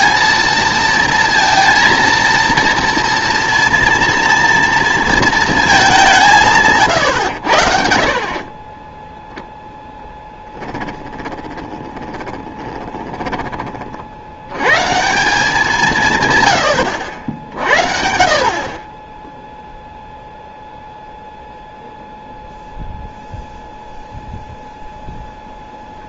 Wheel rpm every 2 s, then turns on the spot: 230, 230, 230, 140, 20, 10, 20, 100, 100, 40, 0, 0, 0.
8-14